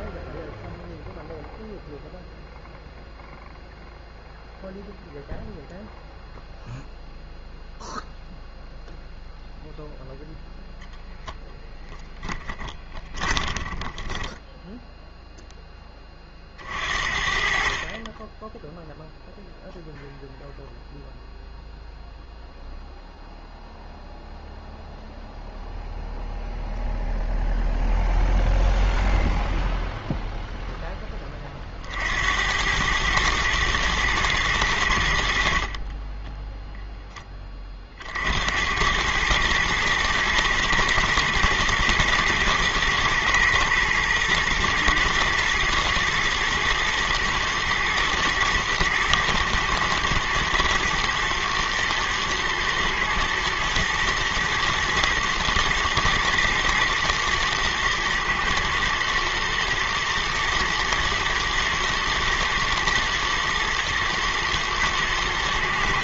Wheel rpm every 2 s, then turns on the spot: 0, 0, 0, 0, 0, 0, 20, 10, 40, 0, 0, 0, 0, 0, 0, 0, 100, 100, 10, 100, 110, 120, 120, 110, 110, 110, 110, 120, 110, 110, 110, 110, 110.
12-16